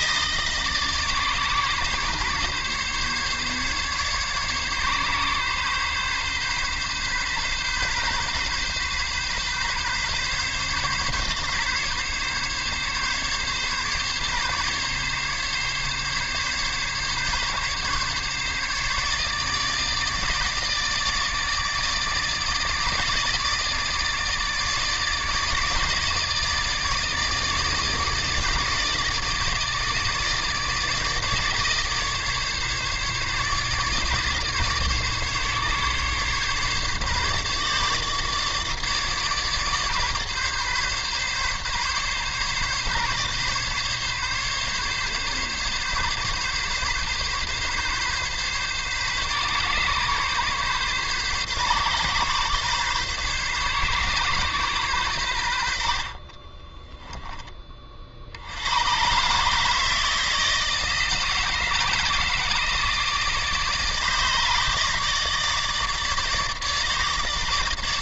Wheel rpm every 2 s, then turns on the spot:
150, 140, 140, 130, 130, 140, 140, 140, 140, 150, 150, 150, 150, 160, 160, 150, 150, 140, 140, 150, 140, 140, 140, 140, 140, 140, 130, 120, 10, 120, 160, 150, 150, 150.
none